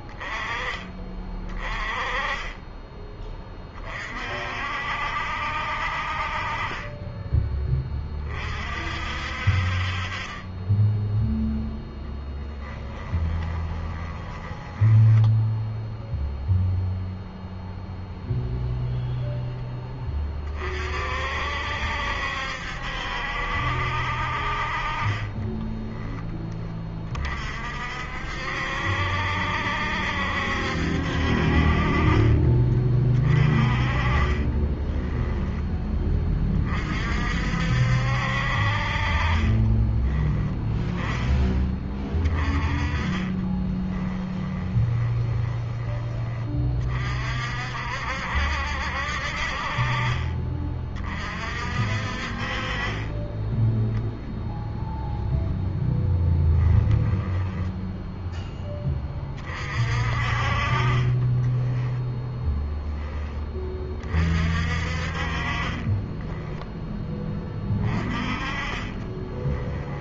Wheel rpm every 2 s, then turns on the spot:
20, 20, 50, 40, 40, 20, 10, 10, 0, 0, 40, 70, 50, 20, 60, 70, 30, 20, 30, 60, 10, 30, 20, 30, 70, 30, 40, 0, 10, 10, 40, 10, 40, 10, 30.
12-16 34-36 42-46 56-58 60-62 68-70